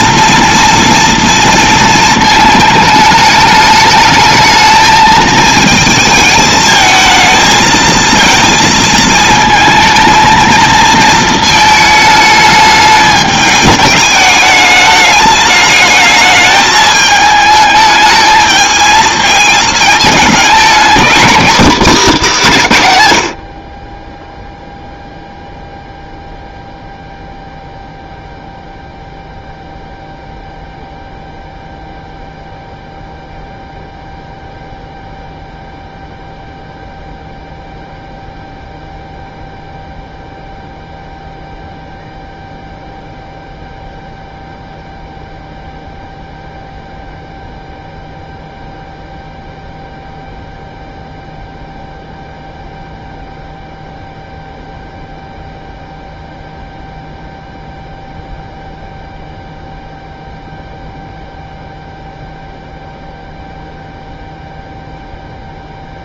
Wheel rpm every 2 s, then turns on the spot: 230, 220, 220, 220, 220, 230, 210, 210, 210, 220, 230, 170, 0, 0, 0, 0, 0, 0, 0, 0, 0, 0, 0, 0, 0, 0, 0, 0, 0, 0, 0, 0, 0.
none